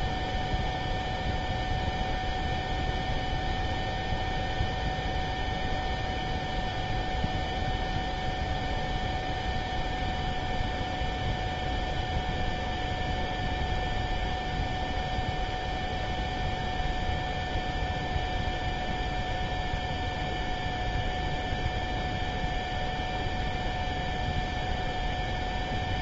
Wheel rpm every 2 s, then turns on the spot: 0, 0, 0, 0, 0, 0, 0, 0, 0, 0, 0, 0, 0.
none